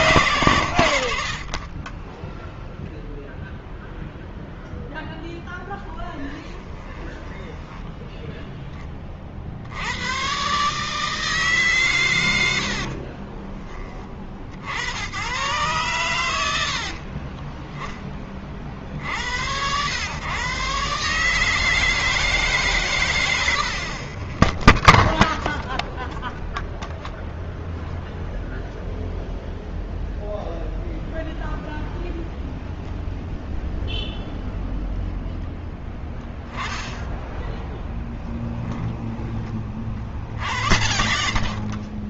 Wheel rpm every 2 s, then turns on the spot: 120, 10, 0, 10, 10, 130, 90, 50, 90, 30, 130, 150, 50, 10, 0, 0, 0, 0, 10, 10, 70.
6-8 24-26 38-42